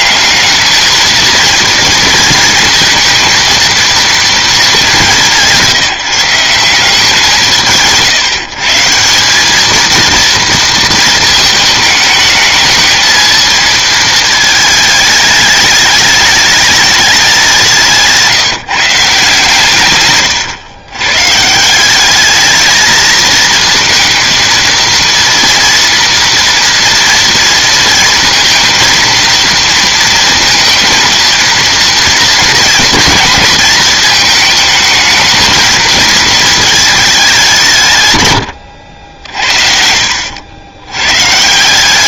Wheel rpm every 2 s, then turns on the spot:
200, 230, 220, 180, 160, 230, 210, 220, 210, 160, 120, 210, 230, 230, 230, 230, 230, 220, 220, 100, 80.
none